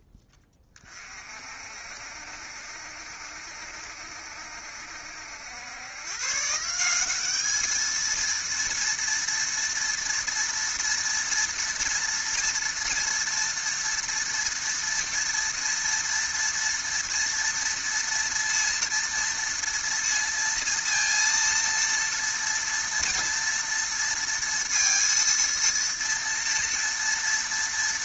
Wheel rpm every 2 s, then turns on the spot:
20, 60, 70, 150, 230, 230, 240, 230, 230, 230, 230, 230, 230, 230.
none